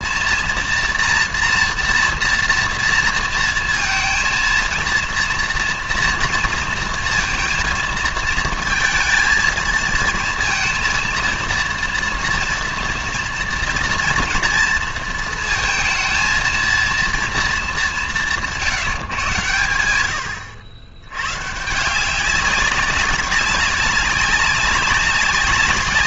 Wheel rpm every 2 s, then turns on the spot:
230, 230, 230, 230, 220, 230, 230, 230, 230, 160, 90, 190, 200.
none